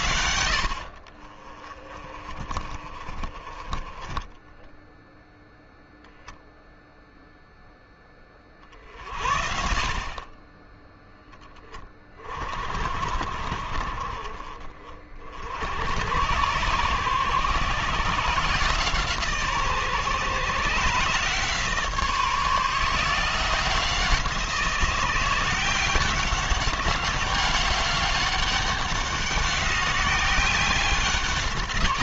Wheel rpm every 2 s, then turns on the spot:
60, 50, 10, 0, 50, 30, 50, 40, 120, 160, 150, 160, 170, 190, 190, 190.
none